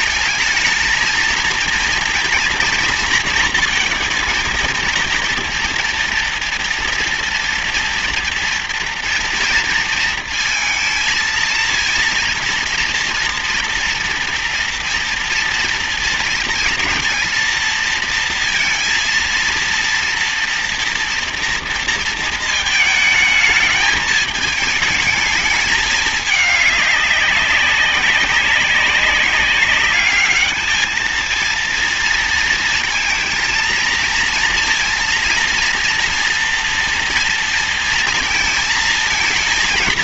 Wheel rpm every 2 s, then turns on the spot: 230, 230, 230, 230, 230, 220, 230, 230, 230, 230, 230, 220, 220, 200, 190, 220, 230, 230, 230, 220.
none